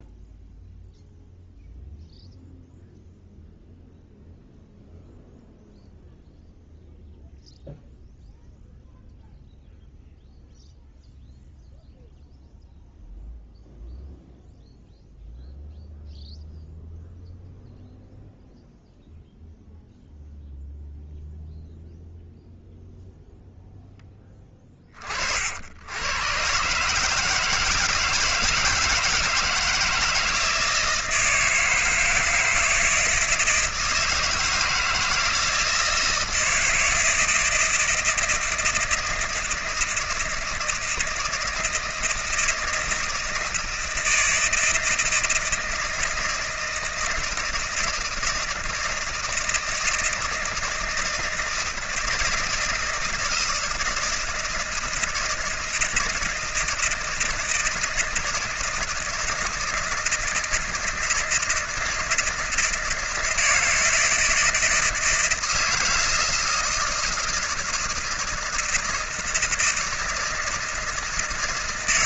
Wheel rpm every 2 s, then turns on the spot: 0, 0, 0, 0, 0, 0, 0, 0, 0, 0, 0, 0, 20, 130, 160, 160, 160, 160, 160, 160, 160, 160, 160, 160, 160, 160, 160, 160, 160, 160, 160, 160, 160, 160, 160, 160.
none